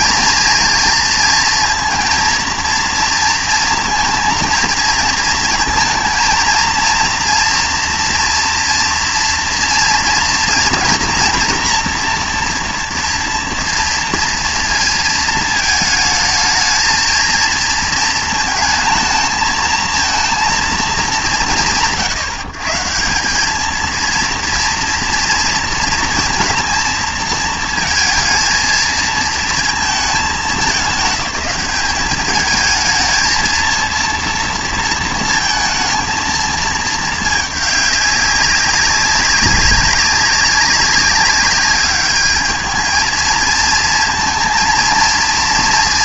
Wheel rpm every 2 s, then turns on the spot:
230, 230, 220, 230, 230, 230, 230, 230, 220, 220, 220, 150, 230, 230, 230, 200, 220, 230, 220, 200, 200, 220, 230.
none